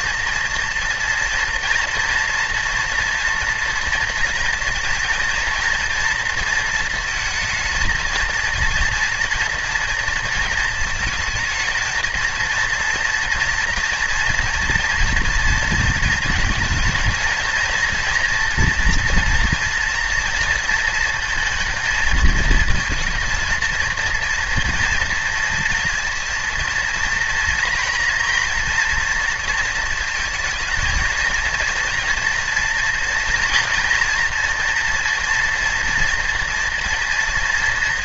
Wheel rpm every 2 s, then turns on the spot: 230, 230, 240, 230, 230, 230, 230, 230, 230, 230, 230, 230, 230, 230, 230, 230, 230, 230, 230.
none